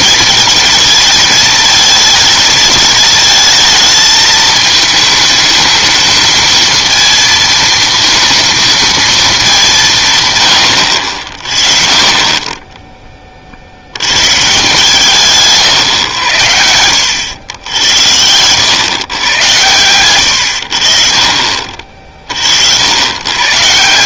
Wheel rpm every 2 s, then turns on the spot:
220, 220, 220, 230, 230, 80, 20, 160, 80, 110, 70, 80.
none